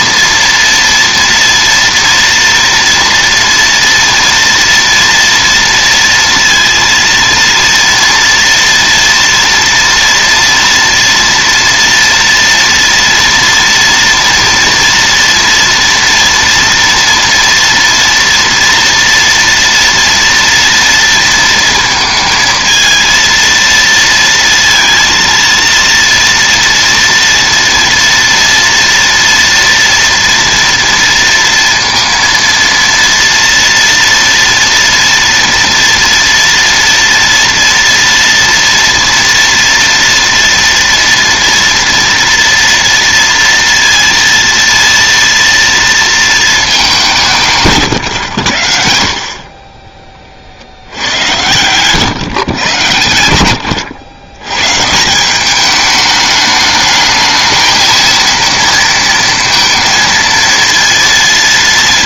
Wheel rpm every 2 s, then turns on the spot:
230, 230, 230, 230, 230, 230, 230, 230, 230, 230, 230, 230, 230, 230, 230, 230, 230, 230, 230, 230, 230, 230, 230, 190, 60, 80, 120, 160, 210, 230, 230.
none